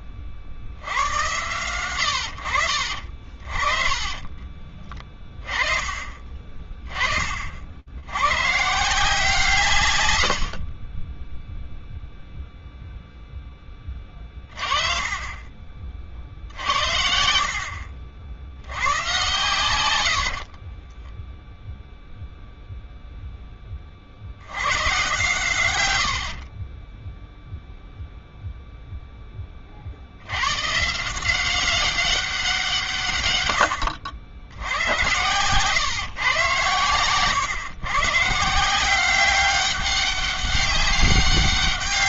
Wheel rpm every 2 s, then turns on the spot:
50, 60, 30, 30, 160, 20, 0, 30, 60, 120, 10, 10, 120, 0, 20, 180, 110, 110, 130, 190, 190.
2-4 20-22